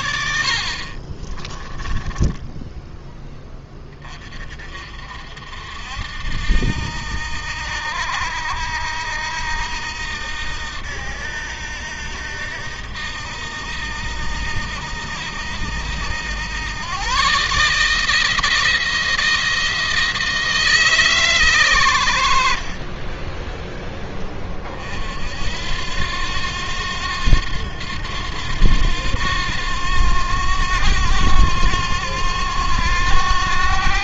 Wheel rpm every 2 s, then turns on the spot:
50, 10, 50, 80, 80, 80, 80, 80, 110, 160, 150, 40, 50, 90, 90, 90, 90.
0-2